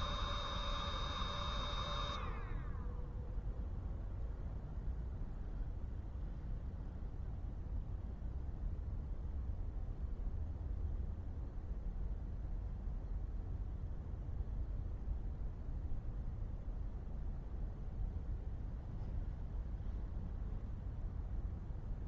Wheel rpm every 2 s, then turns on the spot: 0, 0, 0, 0, 0, 0, 0, 0, 0, 0, 0.
none